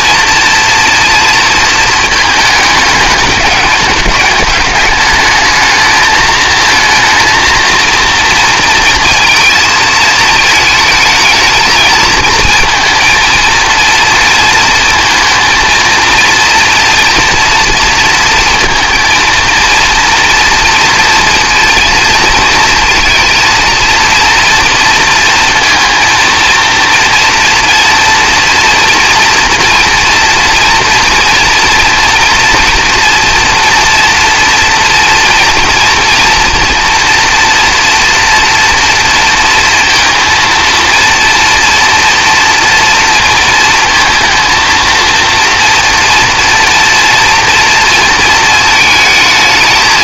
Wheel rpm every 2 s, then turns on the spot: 230, 210, 210, 220, 230, 220, 230, 230, 230, 230, 230, 230, 230, 230, 240, 240, 230, 240, 230, 230, 230, 230, 230, 240, 220.
none